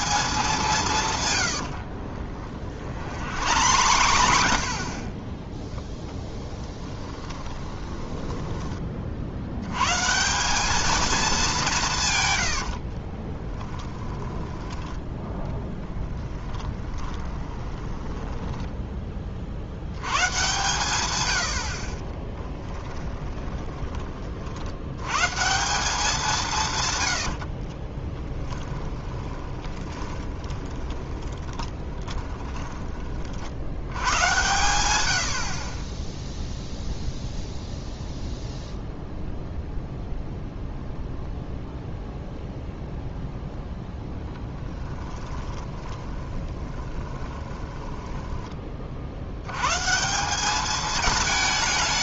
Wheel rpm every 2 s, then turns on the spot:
180, 40, 60, 20, 20, 210, 60, 10, 20, 10, 130, 10, 80, 130, 20, 20, 20, 100, 0, 0, 0, 0, 10, 20, 30, 210.
2-8 12-14 16-18 22-24 28-34 44-48